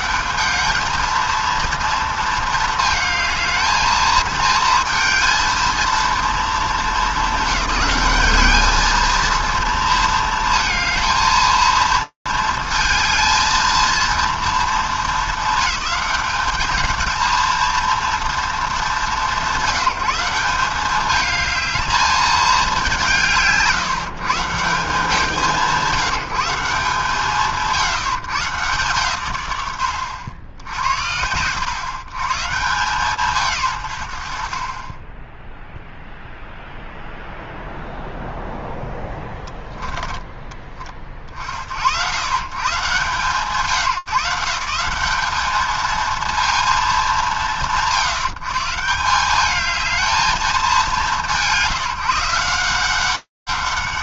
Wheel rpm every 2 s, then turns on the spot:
150, 230, 220, 220, 210, 230, 230, 220, 210, 230, 180, 220, 130, 170, 140, 110, 100, 150, 0, 0, 20, 80, 160, 210, 120, 210, 160.
40-42